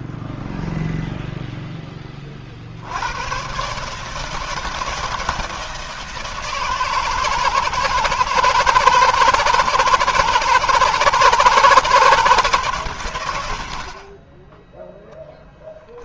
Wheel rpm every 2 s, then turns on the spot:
10, 50, 160, 160, 160, 160, 150, 10.
none